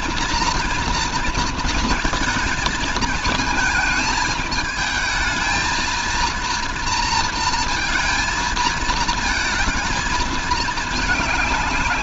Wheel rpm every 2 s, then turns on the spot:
230, 220, 220, 230, 230, 220.
none